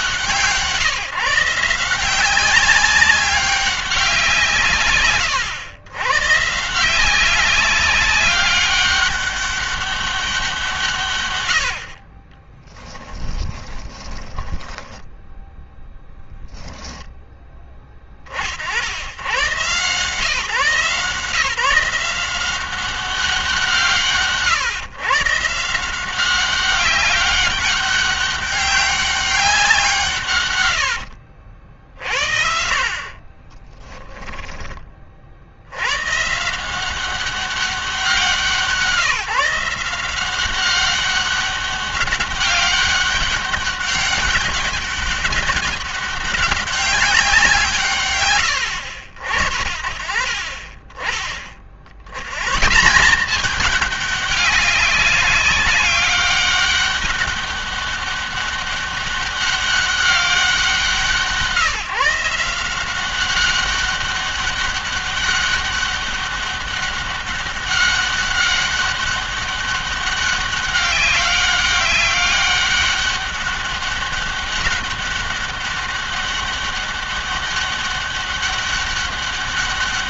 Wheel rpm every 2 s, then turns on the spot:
150, 190, 150, 160, 200, 160, 20, 10, 0, 60, 150, 190, 140, 200, 200, 100, 60, 20, 170, 180, 190, 200, 190, 190, 100, 30, 160, 200, 200, 200, 190, 180, 200, 200, 200, 190, 200, 200, 200, 200.
12-16 30-34